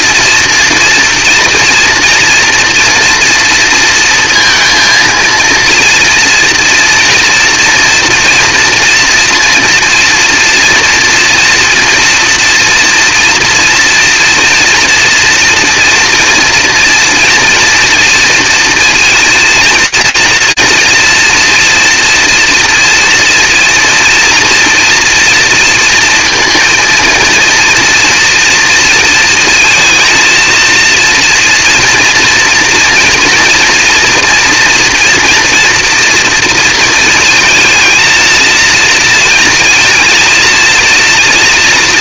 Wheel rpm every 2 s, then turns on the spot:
230, 240, 230, 230, 230, 230, 240, 240, 230, 230, 230, 230, 230, 230, 230, 230, 230, 230, 230, 230, 230.
none